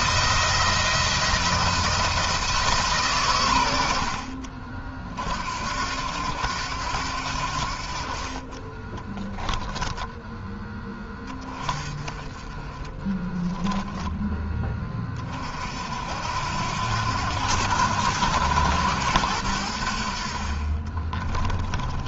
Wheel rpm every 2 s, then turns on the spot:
160, 150, 50, 90, 20, 10, 20, 30, 80, 90, 30.
8-10 12-14 20-22